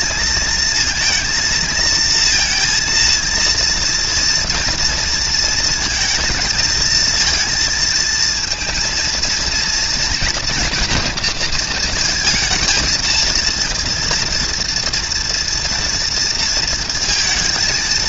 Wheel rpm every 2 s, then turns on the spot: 230, 230, 230, 220, 230, 240, 220, 230, 230.
none